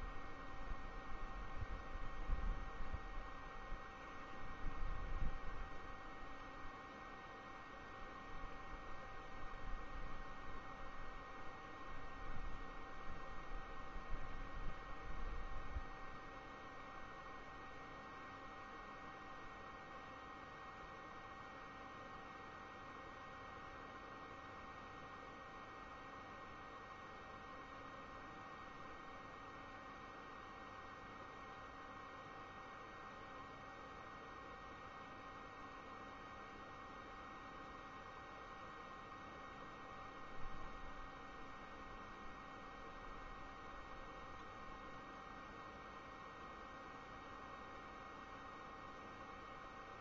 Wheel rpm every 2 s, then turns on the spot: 0, 0, 0, 0, 0, 0, 0, 0, 0, 0, 0, 0, 0, 0, 0, 0, 0, 0, 0, 0, 0, 0, 0, 0, 0.
none